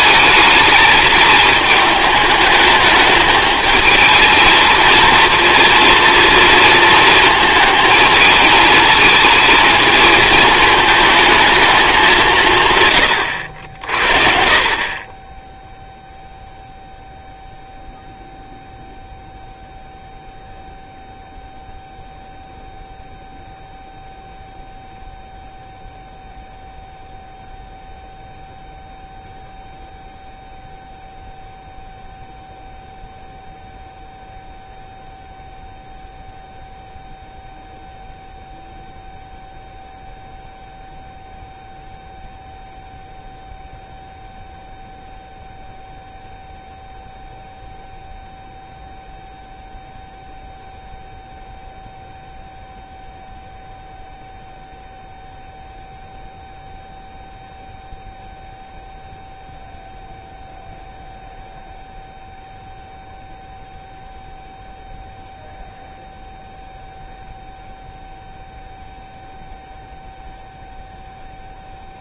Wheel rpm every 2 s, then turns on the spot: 210, 210, 230, 230, 220, 220, 140, 50, 0, 0, 0, 0, 0, 0, 0, 0, 0, 0, 0, 0, 0, 0, 0, 0, 0, 0, 0, 0, 0, 0, 0, 0, 0, 0, 0, 0.
none